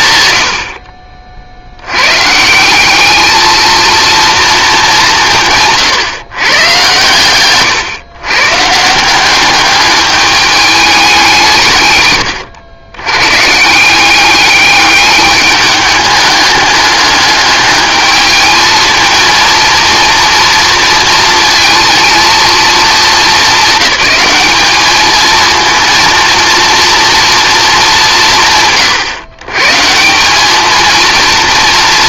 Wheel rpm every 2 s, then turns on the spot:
60, 180, 220, 120, 150, 210, 100, 210, 210, 220, 230, 220, 210, 230, 140, 210.
none